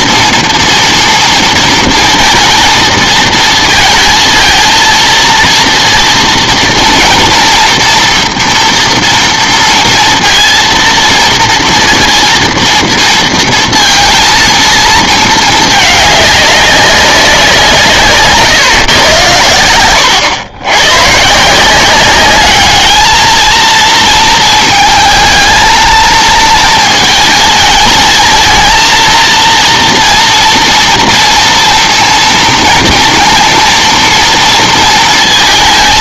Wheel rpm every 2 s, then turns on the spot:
230, 230, 230, 230, 230, 230, 230, 220, 200, 130, 110, 210, 220, 220, 230, 230, 230, 230.
none